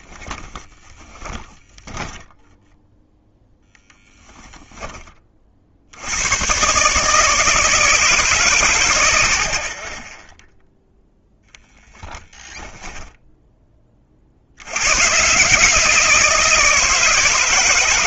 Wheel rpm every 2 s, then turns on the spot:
10, 10, 10, 120, 100, 0, 10, 60, 160.
0-4 12-14